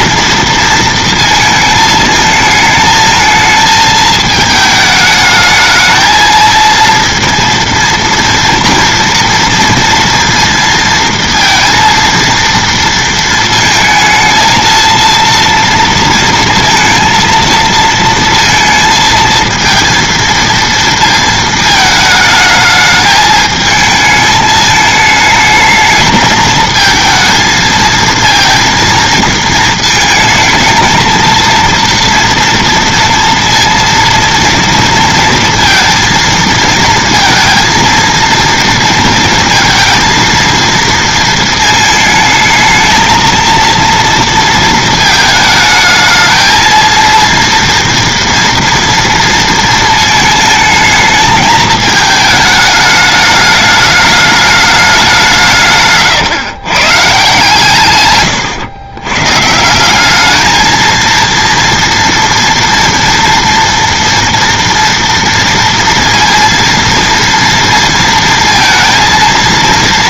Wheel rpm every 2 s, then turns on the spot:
230, 220, 220, 230, 230, 230, 230, 230, 230, 230, 230, 210, 210, 220, 230, 220, 230, 240, 230, 230, 230, 220, 230, 220, 230, 220, 210, 210, 140, 110, 220, 230, 230, 230, 230.
none